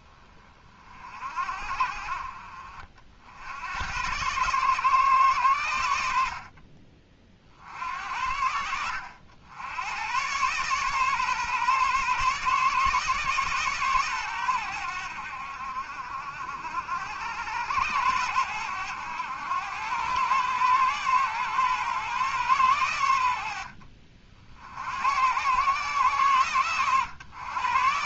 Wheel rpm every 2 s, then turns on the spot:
40, 50, 120, 40, 70, 130, 140, 100, 70, 100, 120, 110, 70, 120.
none